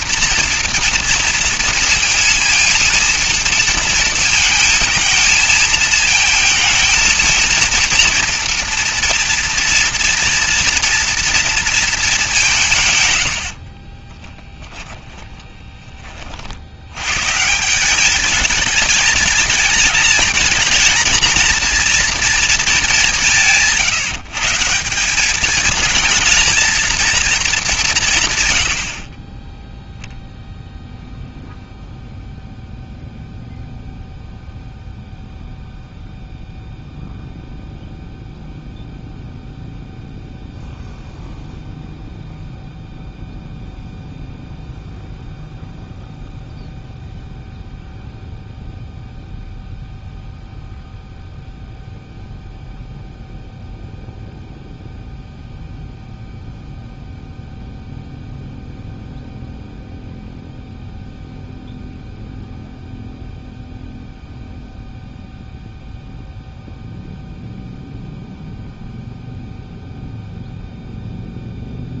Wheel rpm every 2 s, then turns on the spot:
240, 230, 220, 230, 230, 230, 140, 10, 100, 210, 220, 190, 180, 230, 30, 0, 0, 0, 0, 0, 0, 0, 0, 0, 0, 0, 0, 0, 0, 0, 0, 0, 0, 0, 0, 0.
14-16